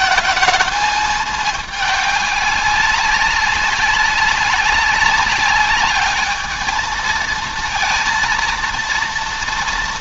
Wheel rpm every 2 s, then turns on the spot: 220, 200, 200, 220, 230.
none